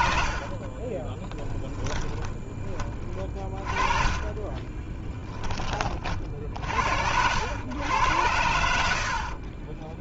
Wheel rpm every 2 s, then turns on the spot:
20, 30, 20, 70, 80.
0-6